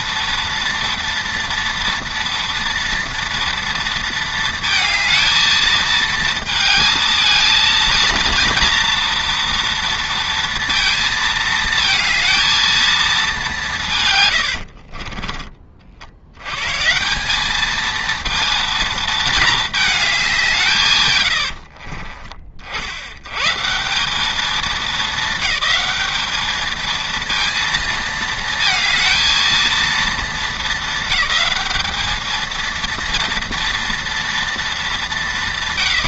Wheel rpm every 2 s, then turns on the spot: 230, 230, 220, 220, 230, 230, 220, 60, 140, 230, 150, 60, 220, 220, 220, 220, 230, 220.
14-16